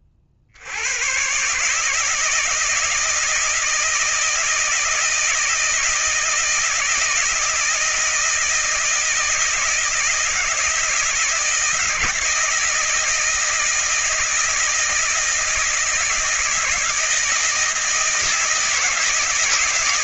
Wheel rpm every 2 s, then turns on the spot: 70, 160, 160, 160, 160, 160, 160, 160, 160, 160.
none